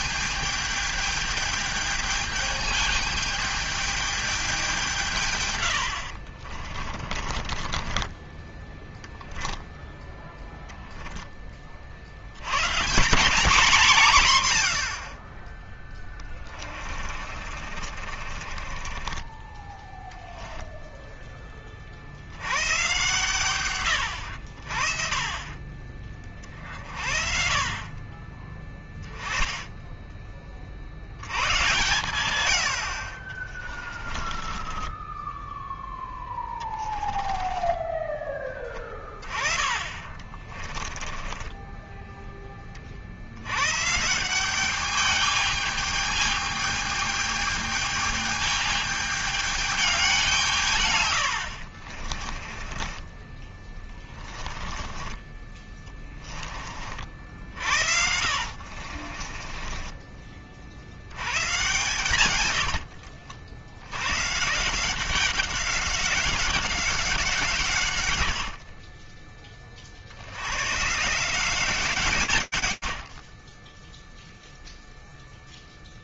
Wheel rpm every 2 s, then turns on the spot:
220, 210, 210, 60, 20, 0, 90, 130, 20, 40, 0, 90, 80, 40, 30, 20, 100, 30, 10, 20, 30, 10, 180, 210, 210, 180, 40, 20, 30, 60, 40, 120, 140, 190, 70, 90, 170, 10.
6-8 16-20 34-38 40-42 52-60 62-64 68-70